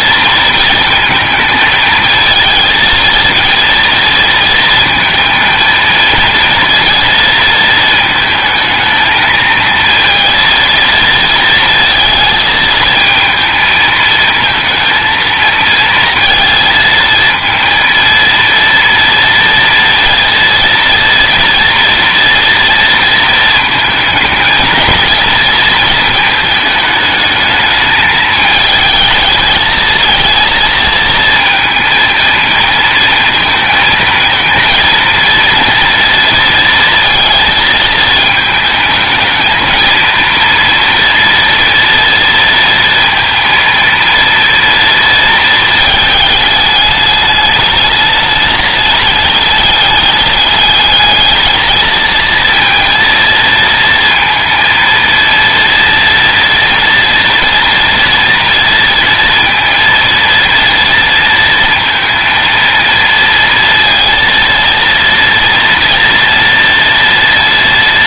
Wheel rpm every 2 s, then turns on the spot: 230, 220, 230, 230, 220, 230, 220, 230, 230, 230, 230, 230, 220, 220, 220, 230, 230, 230, 230, 220, 230, 230, 230, 210, 210, 210, 230, 230, 230, 230, 230, 230, 230, 230.
none